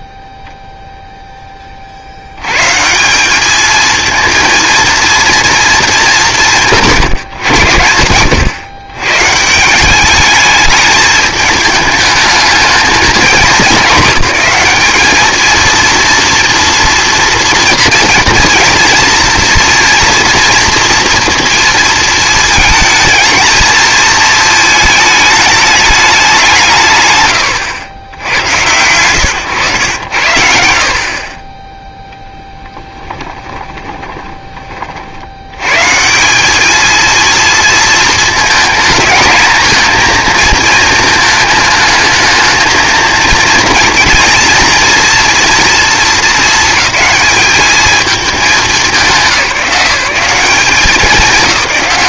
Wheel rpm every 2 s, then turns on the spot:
0, 130, 230, 160, 110, 210, 220, 220, 240, 230, 230, 220, 230, 180, 90, 70, 10, 30, 210, 220, 230, 230, 230, 210, 210, 180.
32-34